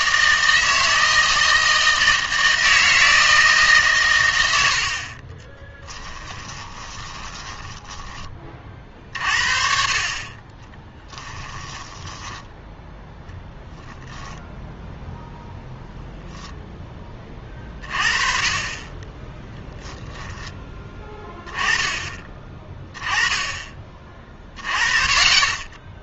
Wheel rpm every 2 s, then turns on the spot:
160, 160, 80, 30, 40, 20, 0, 0, 10, 20, 10, 20, 20.
6-8 10-12